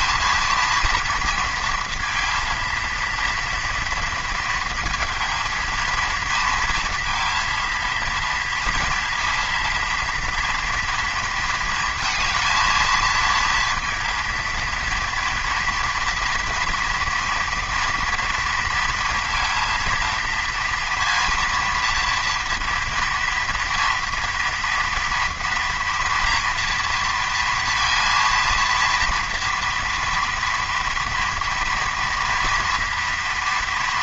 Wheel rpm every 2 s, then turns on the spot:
230, 230, 230, 230, 230, 230, 230, 230, 230, 230, 230, 230, 230, 230, 230, 240, 230.
none